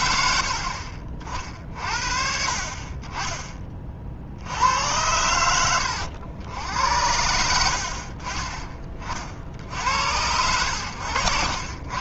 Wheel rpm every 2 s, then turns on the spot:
50, 40, 90, 90, 30, 90.
none